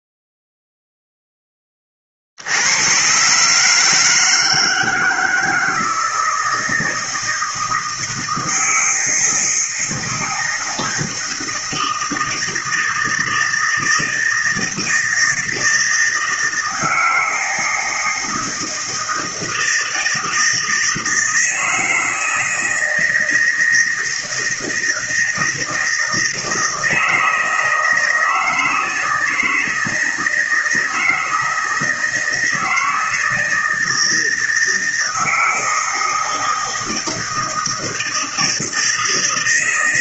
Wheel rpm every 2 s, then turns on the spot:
0, 80, 160, 160, 160, 160, 160, 160, 160, 160, 160, 160, 160, 160, 160, 160, 160, 160, 160, 160.
none